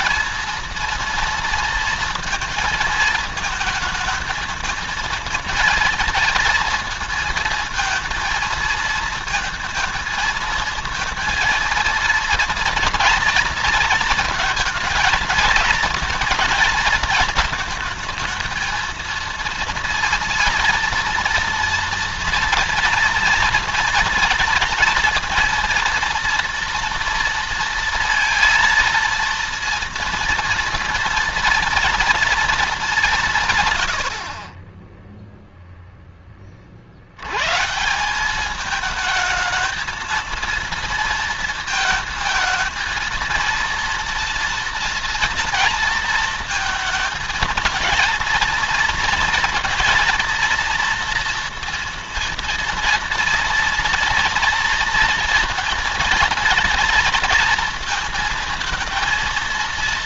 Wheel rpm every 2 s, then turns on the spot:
230, 230, 220, 230, 230, 230, 230, 230, 230, 220, 230, 230, 230, 230, 230, 230, 220, 30, 40, 210, 230, 230, 230, 230, 230, 230, 230, 230, 230, 230.
none